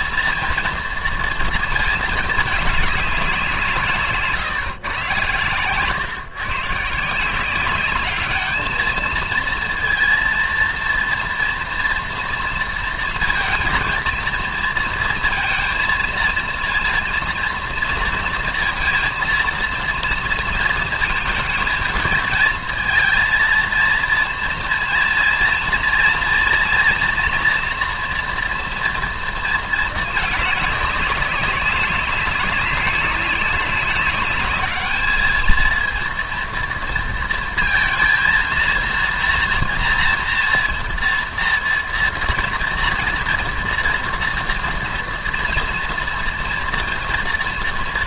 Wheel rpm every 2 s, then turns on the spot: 240, 210, 140, 140, 210, 230, 230, 230, 230, 230, 230, 230, 230, 240, 230, 210, 200, 200, 230, 230, 230, 230, 240, 230.
none